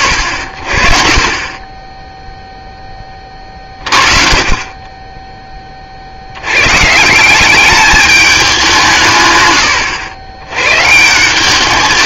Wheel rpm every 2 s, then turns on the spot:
50, 10, 20, 130, 170, 140.
none